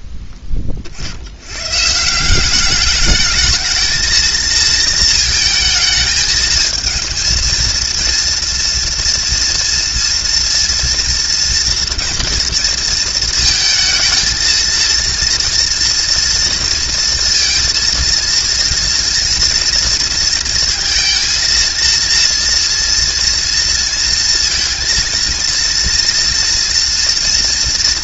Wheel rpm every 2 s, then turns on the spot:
70, 220, 220, 230, 230, 230, 220, 230, 230, 230, 230, 230, 230, 230.
none